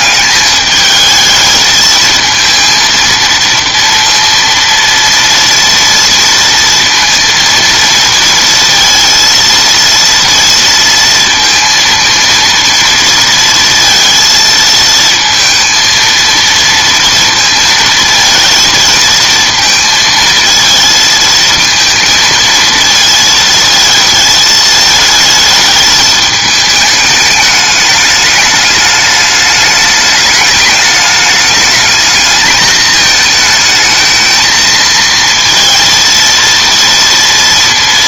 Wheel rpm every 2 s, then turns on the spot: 220, 230, 230, 230, 230, 230, 230, 220, 230, 220, 230, 220, 220, 210, 210, 210, 220, 230, 230.
none